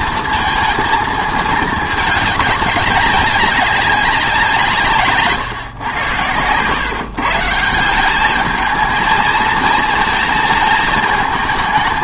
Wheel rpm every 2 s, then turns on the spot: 220, 200, 160, 120, 220, 230.
none